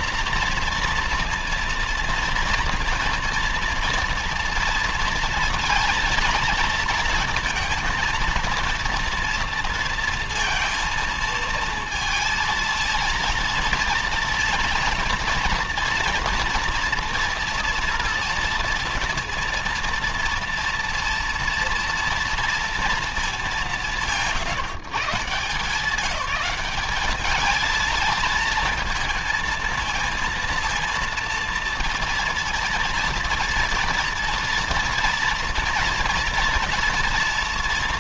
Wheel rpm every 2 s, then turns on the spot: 240, 230, 230, 230, 230, 230, 230, 230, 230, 230, 230, 230, 150, 200, 220, 230, 230, 230, 230.
none